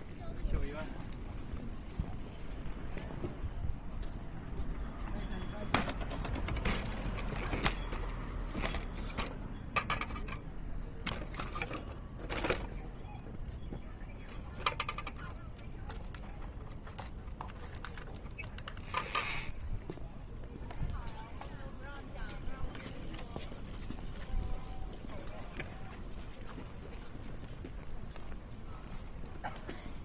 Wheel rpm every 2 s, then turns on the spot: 0, 0, 0, 0, 0, 0, 0, 0, 0, 0, 0, 0, 0, 0, 0.
none